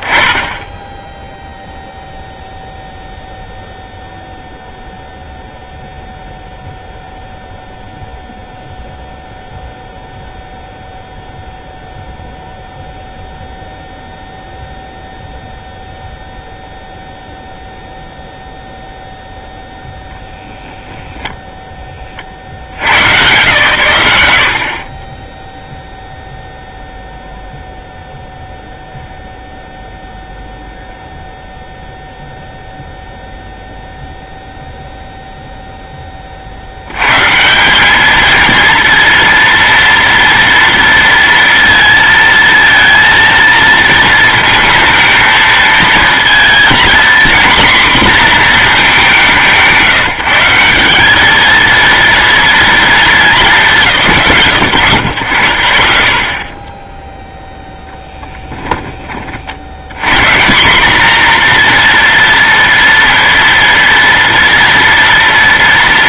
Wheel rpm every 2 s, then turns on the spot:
20, 0, 0, 0, 0, 0, 0, 0, 0, 0, 0, 120, 20, 0, 0, 0, 0, 0, 100, 230, 230, 230, 220, 240, 210, 190, 220, 120, 10, 10, 190, 240, 230.
none